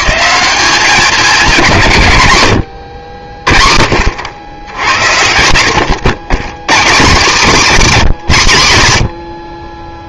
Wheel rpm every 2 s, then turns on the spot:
200, 90, 100, 140, 130.
none